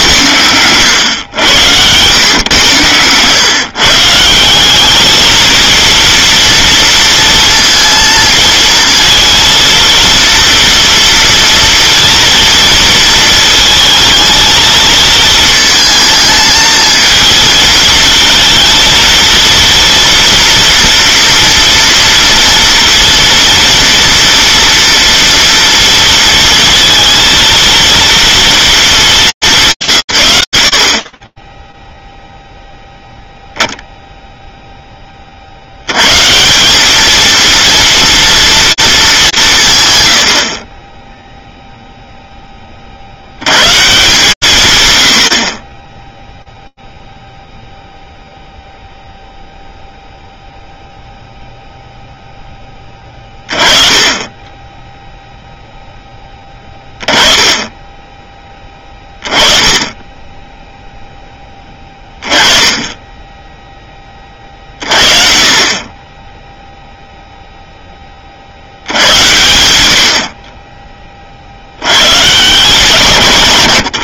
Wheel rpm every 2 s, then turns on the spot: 100, 120, 180, 230, 230, 230, 230, 220, 220, 220, 230, 230, 230, 230, 230, 120, 0, 0, 180, 230, 40, 60, 110, 0, 0, 0, 20, 0, 10, 30, 10, 10, 50, 0, 60, 60, 100.
none